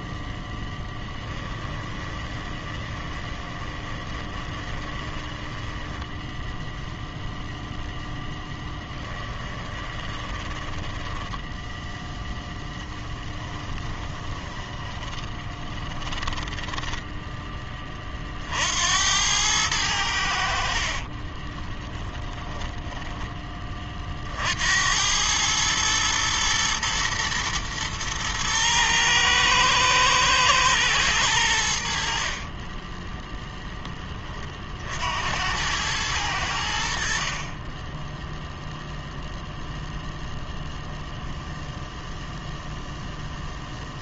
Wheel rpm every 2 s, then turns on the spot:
10, 20, 20, 0, 10, 20, 10, 20, 10, 60, 70, 20, 70, 110, 110, 120, 30, 40, 80, 0, 0, 0.
2-6 8-12 14-18 20-24 32-34